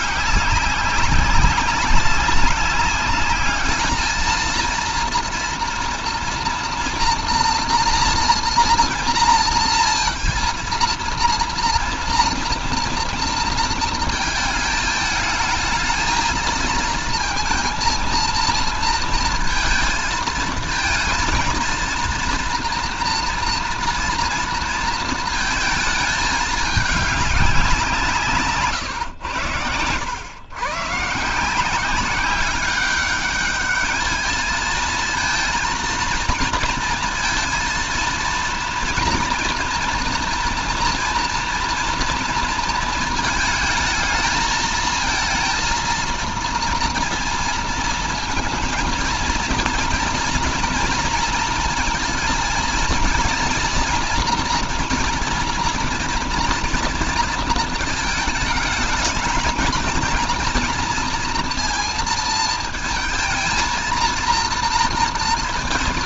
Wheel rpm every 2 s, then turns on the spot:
200, 200, 220, 230, 230, 230, 230, 220, 220, 230, 230, 240, 230, 220, 140, 110, 190, 220, 230, 230, 230, 230, 220, 230, 230, 230, 230, 240, 230, 220, 240, 230, 230.
none